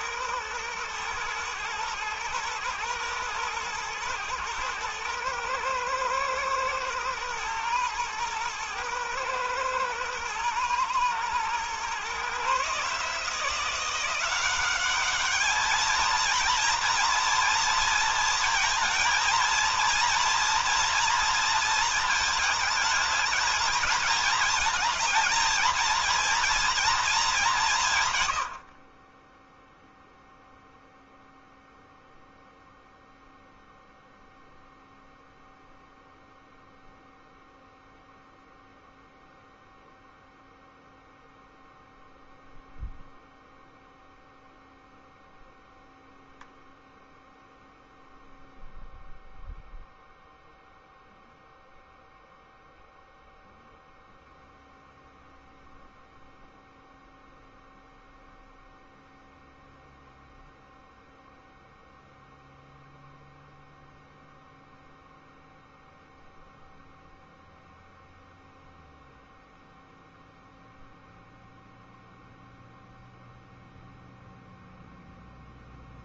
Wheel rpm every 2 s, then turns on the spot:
110, 120, 110, 110, 110, 110, 150, 200, 230, 230, 230, 220, 220, 220, 30, 0, 0, 0, 0, 0, 0, 0, 0, 0, 0, 0, 0, 0, 0, 0, 0, 0, 0, 0, 0, 0, 0, 0.
none